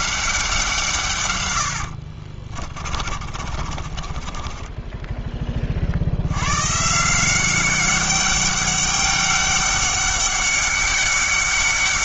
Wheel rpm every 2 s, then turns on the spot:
170, 30, 20, 120, 200, 200.
2-6